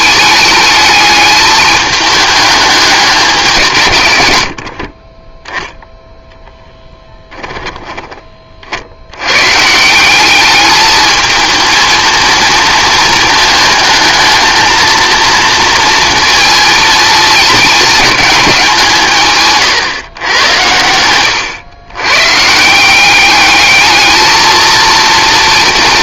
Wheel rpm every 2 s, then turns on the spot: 210, 200, 40, 10, 70, 210, 220, 230, 230, 170, 100, 180, 230.
none